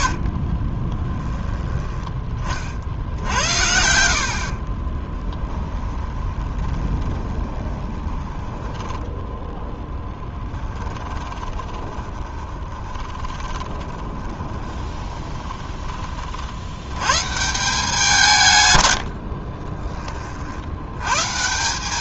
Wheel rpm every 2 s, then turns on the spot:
30, 50, 30, 20, 10, 10, 30, 20, 90, 110, 80.
0-2 4-16